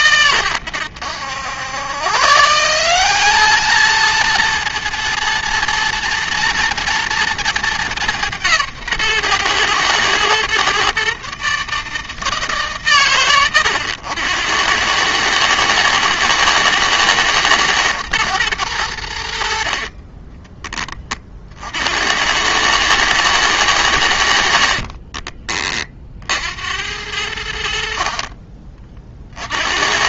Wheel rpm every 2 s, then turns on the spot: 100, 180, 230, 230, 140, 130, 140, 100, 110, 90, 30, 110, 40, 80, 40.
24-26